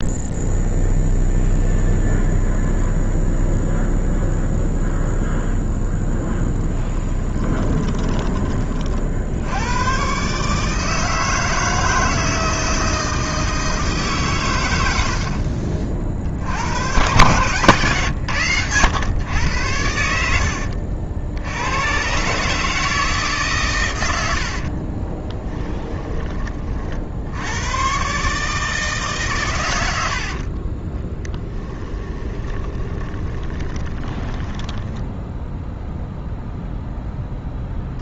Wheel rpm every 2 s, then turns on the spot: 0, 0, 0, 10, 60, 160, 160, 80, 100, 100, 70, 160, 40, 60, 150, 20, 30, 0, 0.
6-8 24-26 32-34